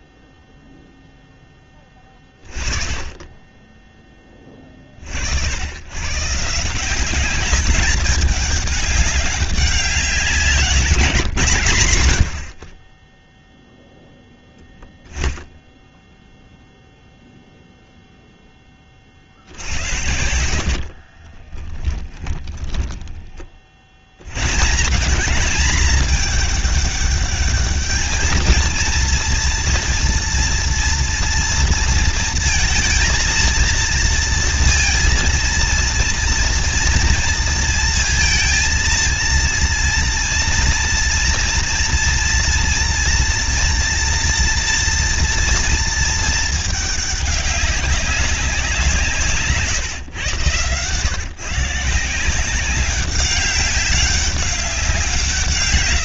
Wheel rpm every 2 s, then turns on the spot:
20, 40, 140, 210, 160, 90, 0, 0, 0, 80, 20, 30, 210, 210, 230, 230, 230, 230, 230, 230, 230, 240, 230, 200, 150, 150, 200, 150.
20-22